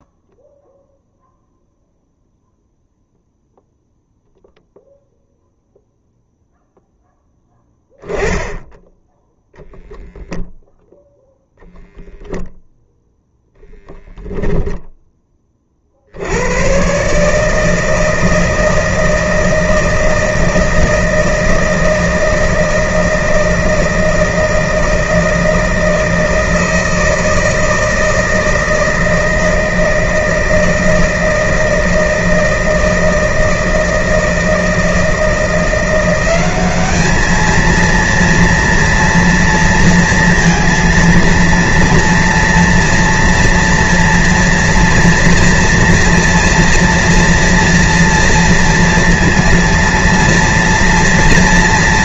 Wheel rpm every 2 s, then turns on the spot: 0, 0, 0, 0, 10, 0, 0, 0, 100, 160, 160, 160, 160, 160, 160, 160, 160, 160, 200, 230, 230, 230, 230, 230, 230, 230.
none